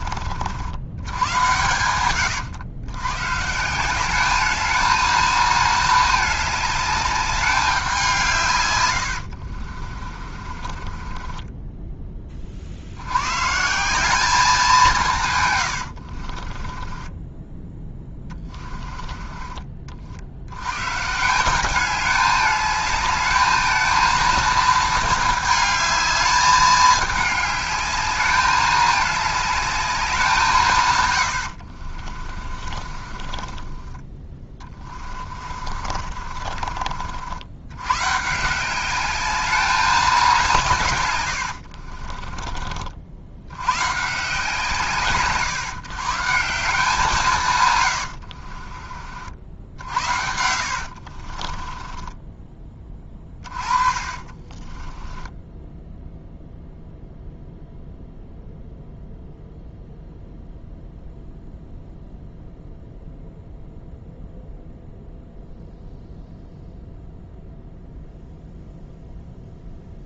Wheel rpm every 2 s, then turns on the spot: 90, 100, 220, 210, 110, 30, 70, 180, 20, 20, 110, 210, 220, 210, 210, 130, 30, 30, 50, 190, 130, 40, 130, 170, 40, 70, 20, 10, 0, 0, 0, 0, 0, 0, 0.
8-12 16-20 32-36 48-56